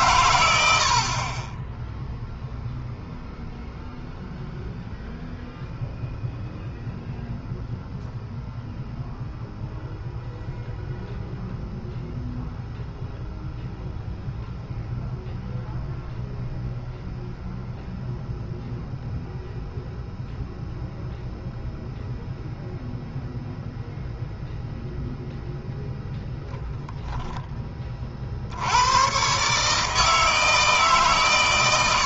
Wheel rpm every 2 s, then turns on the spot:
70, 0, 0, 0, 0, 0, 0, 0, 0, 0, 0, 0, 0, 0, 100, 150.
none